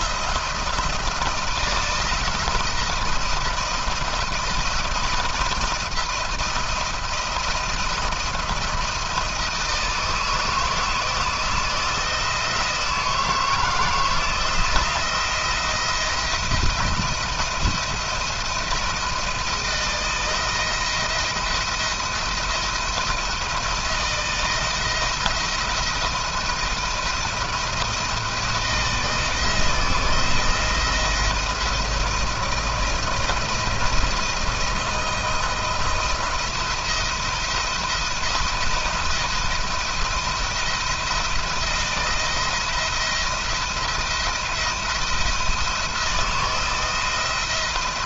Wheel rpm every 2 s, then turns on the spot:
170, 170, 170, 170, 170, 160, 170, 170, 160, 160, 170, 170, 170, 170, 160, 170, 160, 160, 170, 170, 170, 170, 170, 170.
none